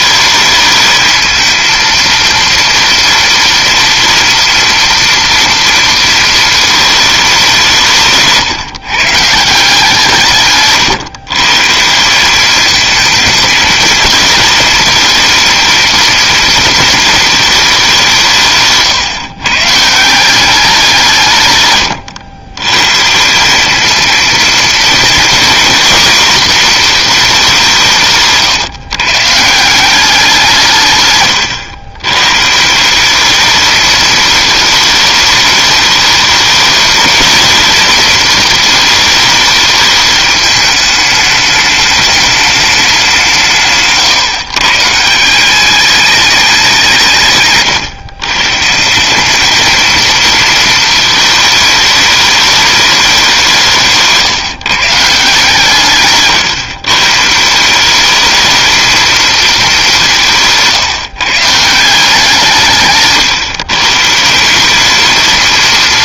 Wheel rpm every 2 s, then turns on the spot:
210, 230, 230, 220, 140, 140, 210, 220, 230, 140, 190, 110, 230, 240, 140, 160, 160, 210, 210, 220, 210, 200, 140, 180, 150, 220, 210, 160, 130, 220, 160, 150, 190.
none